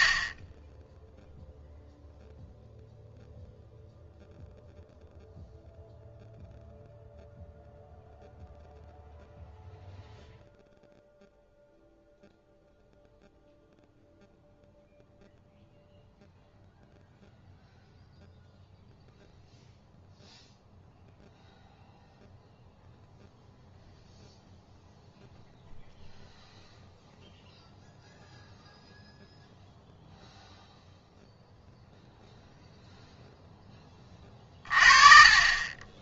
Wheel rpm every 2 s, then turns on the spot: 10, 0, 0, 0, 0, 0, 0, 0, 0, 0, 0, 0, 0, 0, 0, 0, 0, 30.
none